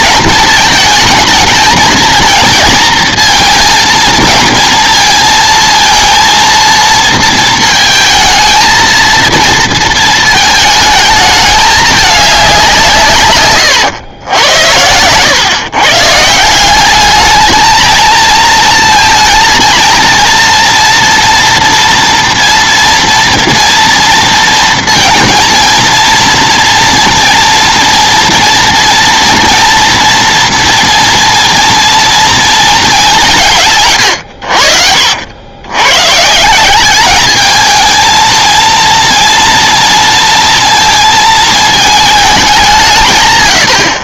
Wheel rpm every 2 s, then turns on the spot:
220, 230, 230, 230, 220, 220, 170, 100, 180, 220, 230, 230, 230, 230, 230, 230, 220, 70, 180, 230, 230, 180.
none